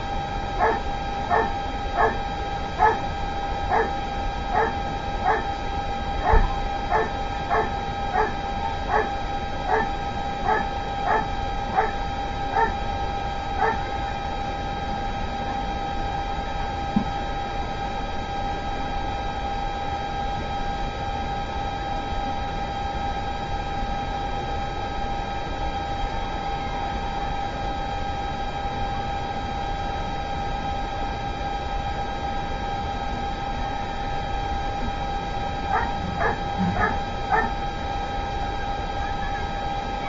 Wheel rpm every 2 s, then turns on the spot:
0, 0, 0, 0, 0, 0, 0, 0, 0, 0, 0, 0, 0, 0, 0, 0, 0, 0, 0, 0.
none